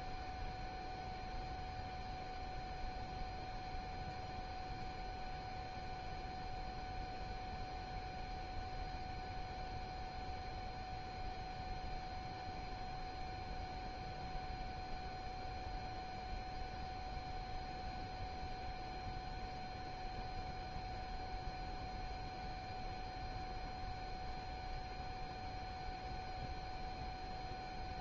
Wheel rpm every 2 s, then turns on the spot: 0, 0, 0, 0, 0, 0, 0, 0, 0, 0, 0, 0, 0, 0.
none